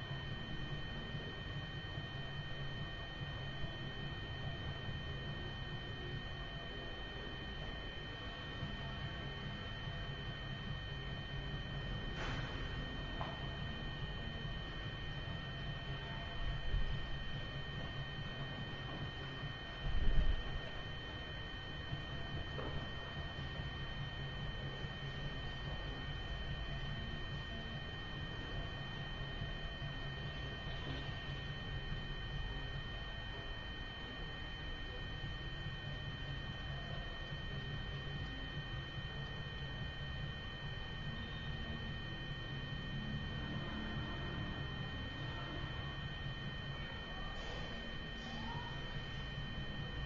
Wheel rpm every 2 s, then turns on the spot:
0, 0, 0, 0, 0, 0, 0, 0, 0, 0, 0, 0, 0, 0, 0, 0, 0, 0, 0, 0, 0, 0, 0, 0, 0.
none